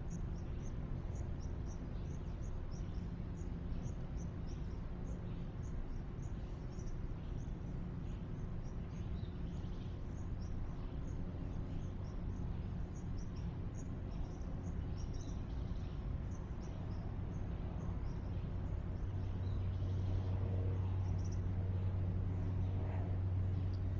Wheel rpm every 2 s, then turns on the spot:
0, 0, 0, 0, 0, 0, 0, 0, 0, 0, 0, 0.
none